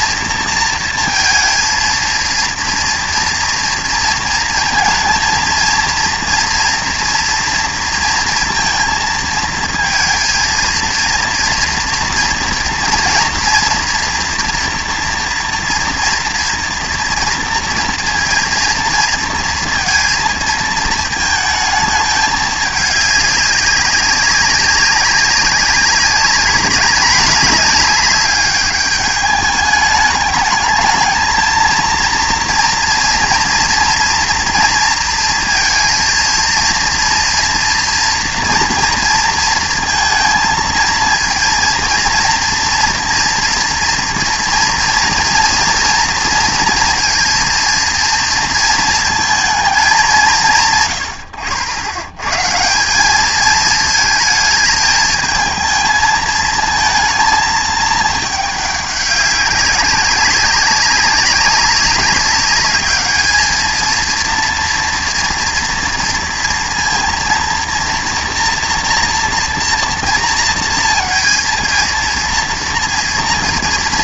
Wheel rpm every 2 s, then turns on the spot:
230, 230, 230, 240, 230, 230, 230, 240, 230, 230, 230, 210, 190, 200, 200, 220, 230, 230, 230, 230, 230, 230, 230, 230, 220, 150, 160, 220, 230, 210, 200, 210, 230, 230, 240, 230, 230.
none